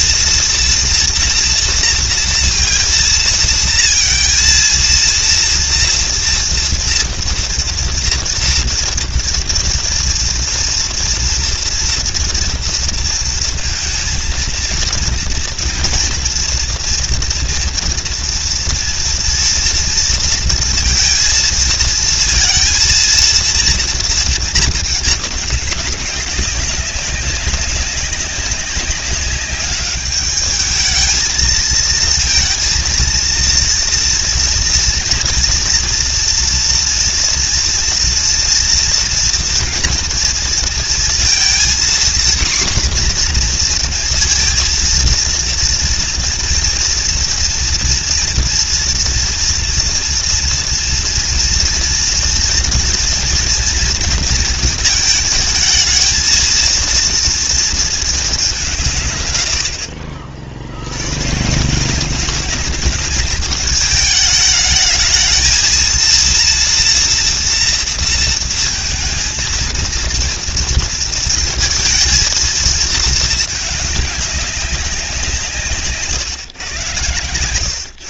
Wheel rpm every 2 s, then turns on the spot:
230, 230, 230, 230, 230, 230, 230, 230, 230, 240, 230, 230, 220, 190, 190, 210, 230, 230, 240, 230, 230, 250, 230, 230, 230, 230, 230, 220, 230, 170, 60, 200, 210, 230, 230, 230, 220, 200, 120.
none